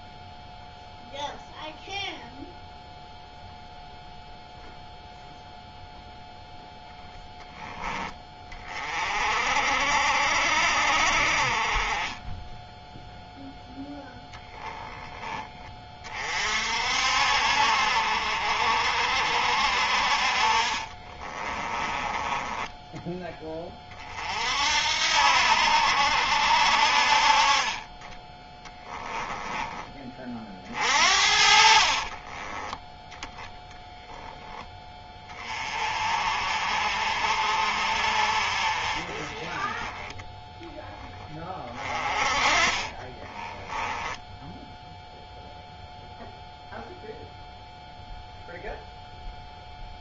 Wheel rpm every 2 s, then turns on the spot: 0, 0, 0, 0, 30, 50, 0, 10, 50, 50, 30, 10, 60, 50, 10, 50, 10, 10, 50, 30, 20, 30, 0, 0, 0.
20-24 28-30 42-44